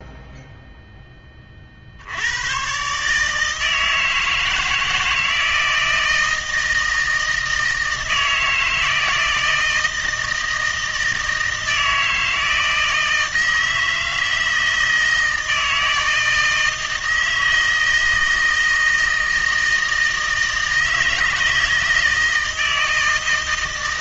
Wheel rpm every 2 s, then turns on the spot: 0, 120, 160, 160, 160, 160, 160, 160, 160, 160, 160, 160.
none